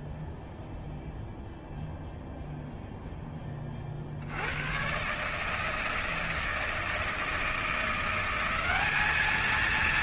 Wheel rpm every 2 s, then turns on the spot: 0, 0, 130, 160, 200.
none